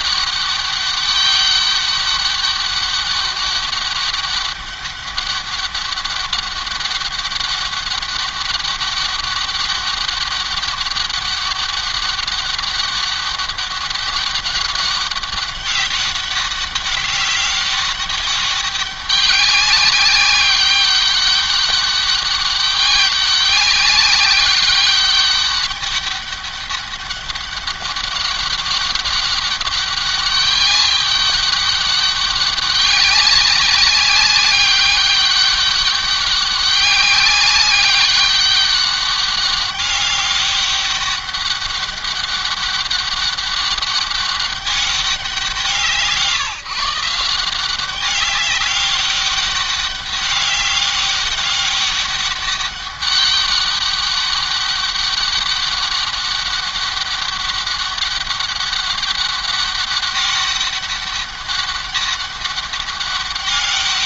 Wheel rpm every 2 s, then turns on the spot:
200, 200, 200, 200, 200, 200, 200, 200, 200, 200, 200, 200, 200, 200, 200, 200, 200, 200, 200, 200, 200, 200, 180, 180, 200, 200, 200, 200, 200, 200, 200, 200.
none